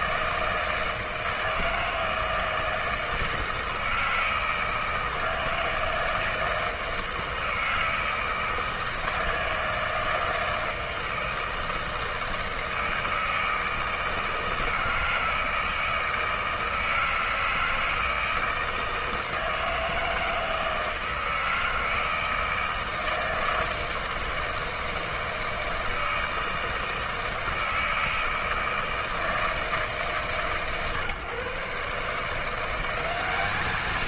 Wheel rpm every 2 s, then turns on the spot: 160, 160, 160, 160, 160, 160, 160, 160, 160, 160, 160, 160, 160, 160, 160, 140, 180.
none